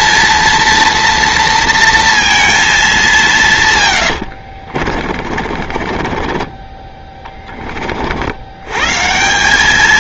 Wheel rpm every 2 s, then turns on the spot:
230, 210, 50, 30, 100.
4-8